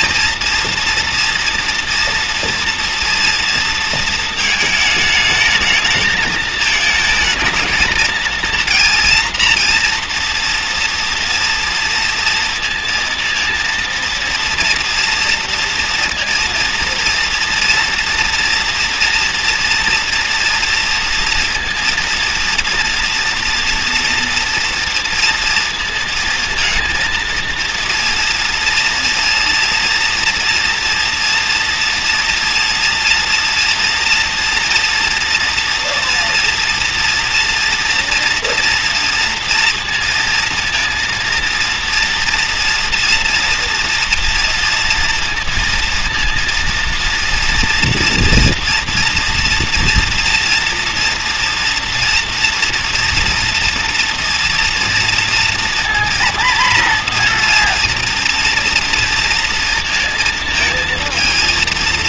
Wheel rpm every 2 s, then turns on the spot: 240, 230, 220, 220, 230, 230, 230, 230, 230, 240, 230, 230, 230, 230, 230, 230, 230, 230, 240, 230, 230, 230, 240, 230, 240, 230, 230, 230, 230, 230, 230.
none